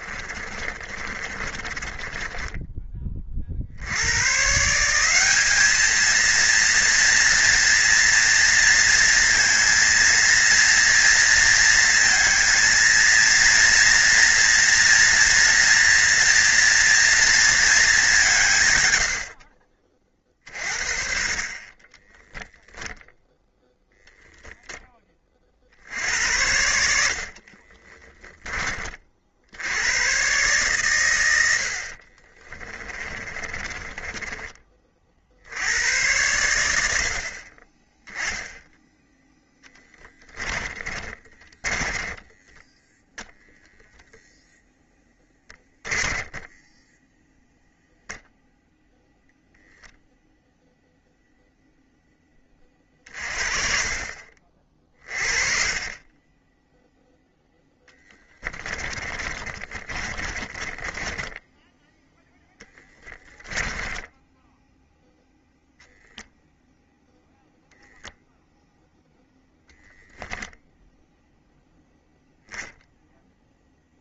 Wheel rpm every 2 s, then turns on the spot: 30, 20, 150, 230, 230, 230, 230, 230, 230, 140, 30, 0, 10, 70, 20, 120, 30, 20, 90, 10, 20, 10, 10, 10, 0, 0, 40, 30, 20, 20, 20, 0, 0, 0, 0, 0, 0.
0-4 32-34 40-46 58-62